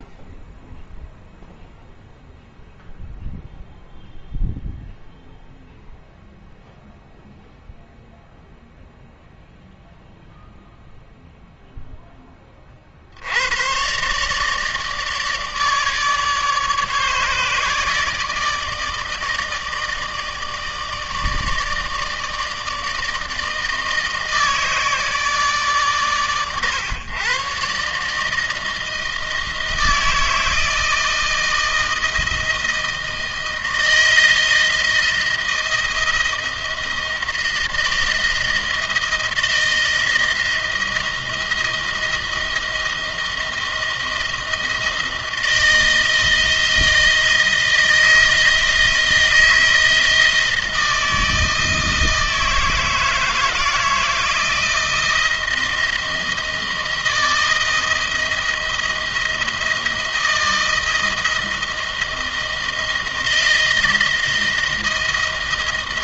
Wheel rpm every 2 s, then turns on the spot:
0, 0, 0, 0, 0, 0, 40, 150, 150, 160, 160, 160, 160, 120, 160, 160, 160, 160, 170, 160, 160, 160, 160, 170, 160, 160, 160, 170, 160, 160, 160, 170, 160.
none